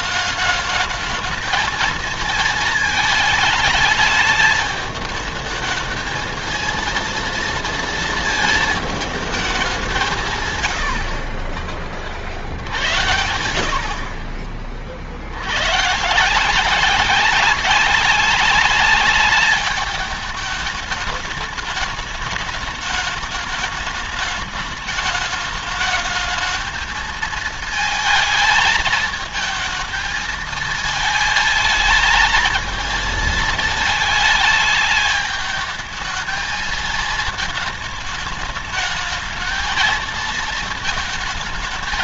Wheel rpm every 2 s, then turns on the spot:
210, 230, 220, 230, 220, 140, 70, 50, 180, 200, 210, 210, 210, 220, 220, 220, 230, 210, 220, 220, 220.
none